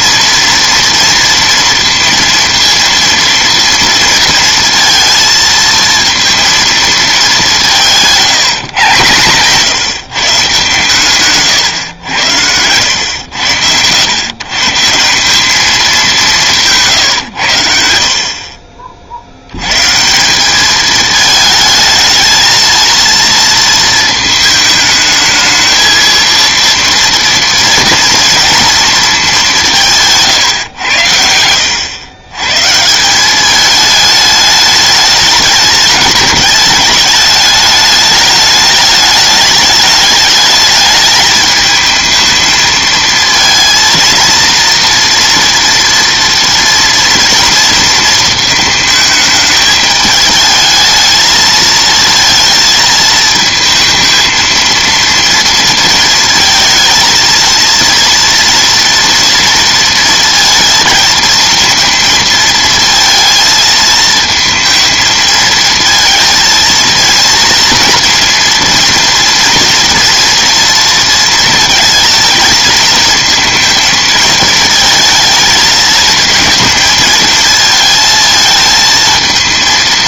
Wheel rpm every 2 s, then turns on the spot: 230, 230, 230, 230, 150, 150, 100, 140, 150, 40, 210, 220, 220, 230, 230, 130, 140, 210, 210, 210, 210, 220, 230, 230, 220, 220, 220, 230, 230, 240, 230, 230, 220, 230, 230, 230, 220, 220, 220, 220.
none